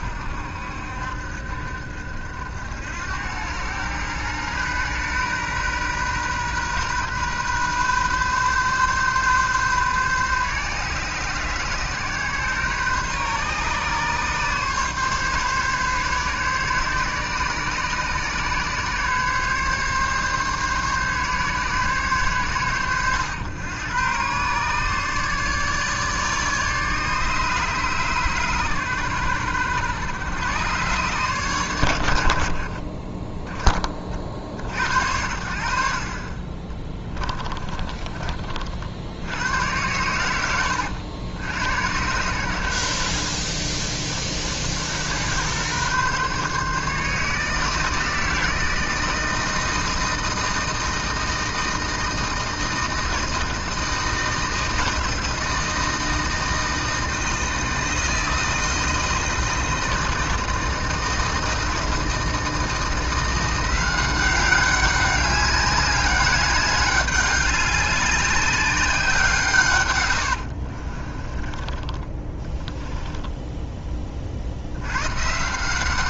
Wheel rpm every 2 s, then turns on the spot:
70, 80, 120, 130, 130, 130, 130, 140, 140, 140, 140, 110, 140, 150, 120, 120, 40, 60, 20, 50, 90, 90, 80, 150, 160, 160, 160, 160, 160, 160, 160, 170, 190, 200, 190, 50, 10, 90.
36-38 70-74